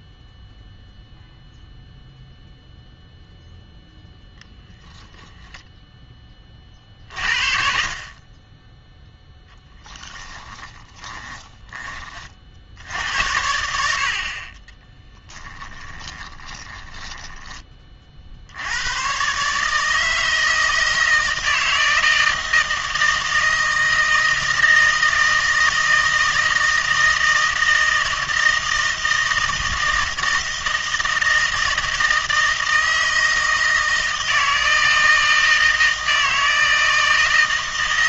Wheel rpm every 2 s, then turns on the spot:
0, 0, 0, 40, 10, 20, 70, 40, 20, 90, 160, 160, 160, 160, 160, 160, 160, 160, 160.
10-12 14-18